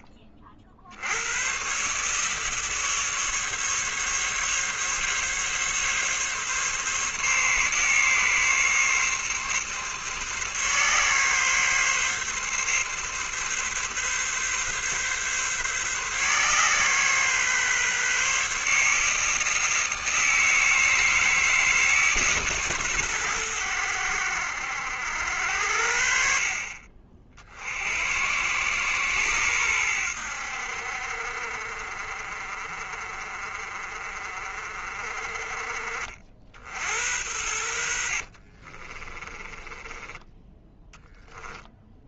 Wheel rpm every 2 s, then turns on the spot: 80, 150, 140, 140, 140, 140, 140, 140, 130, 150, 160, 120, 70, 50, 120, 60, 40, 40, 80, 30, 10.
38-40